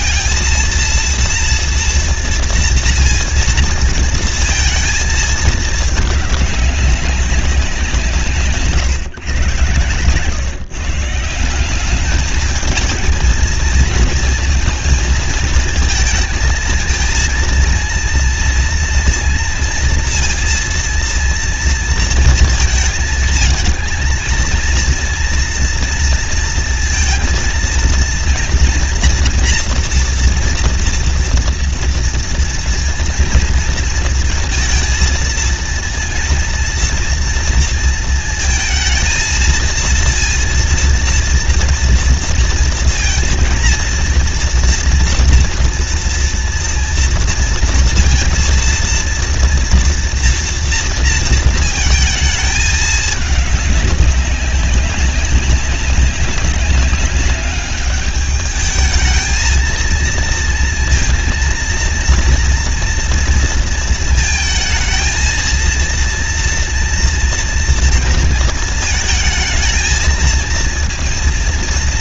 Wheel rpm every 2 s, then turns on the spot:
230, 230, 230, 200, 150, 140, 210, 230, 220, 230, 230, 230, 230, 230, 230, 240, 230, 230, 230, 220, 230, 230, 230, 230, 230, 230, 220, 200, 200, 210, 230, 230, 220, 230, 230, 230.
8-10